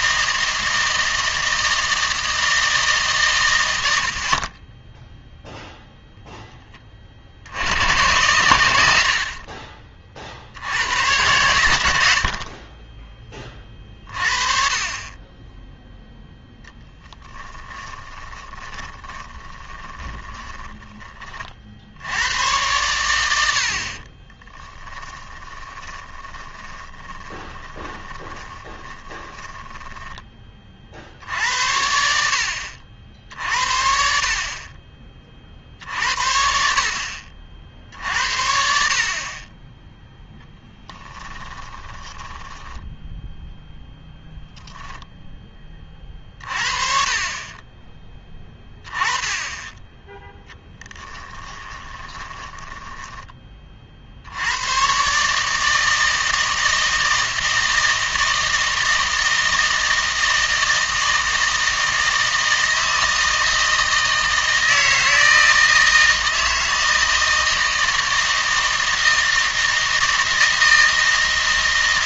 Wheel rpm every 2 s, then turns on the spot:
160, 160, 20, 10, 80, 90, 30, 30, 0, 20, 10, 100, 20, 30, 20, 50, 70, 30, 50, 60, 10, 10, 0, 30, 10, 10, 20, 110, 160, 160, 160, 160, 160, 160, 160, 160.
18-20 24-30 40-44 50-54